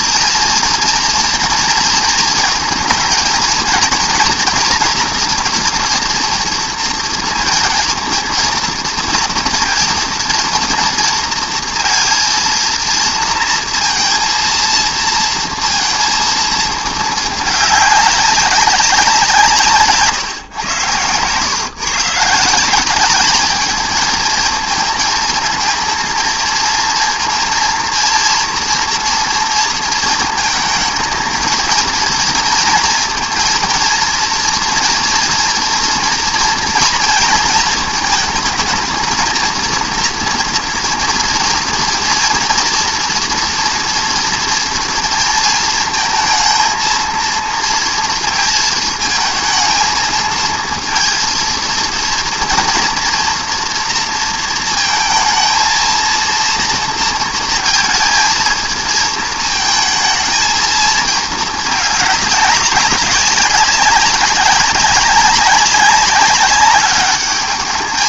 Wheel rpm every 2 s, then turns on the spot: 230, 230, 240, 230, 230, 230, 230, 230, 220, 180, 110, 200, 220, 230, 230, 230, 230, 230, 230, 220, 230, 230, 230, 230, 220, 230, 230, 220, 230, 220, 220, 190, 190, 210.
none